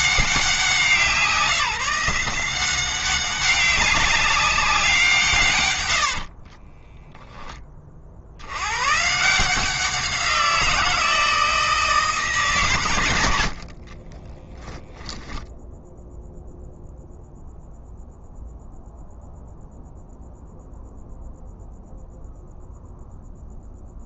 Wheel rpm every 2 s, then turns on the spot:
180, 180, 180, 30, 120, 170, 110, 0, 0, 0, 0, 0.
6-8